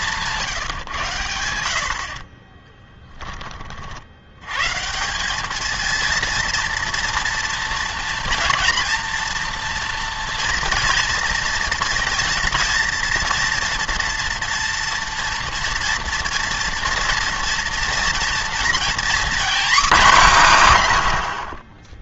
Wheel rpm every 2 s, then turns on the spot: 150, 20, 140, 230, 230, 230, 230, 230, 230, 230, 150.
2-4